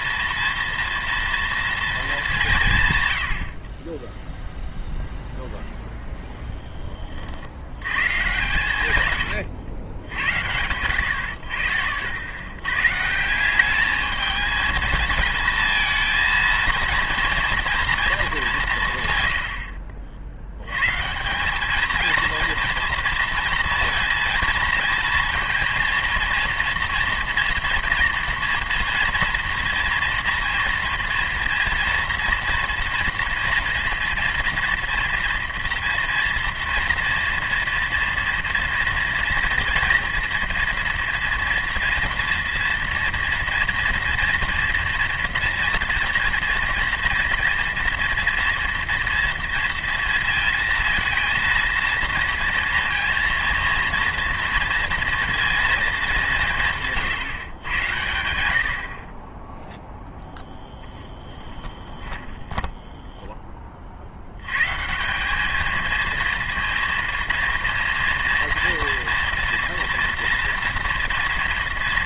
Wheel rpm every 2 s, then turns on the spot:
230, 160, 0, 10, 100, 90, 120, 220, 230, 160, 110, 230, 230, 230, 230, 230, 230, 230, 230, 230, 230, 240, 230, 230, 230, 230, 230, 230, 150, 60, 20, 10, 130, 230, 230, 230.
60-64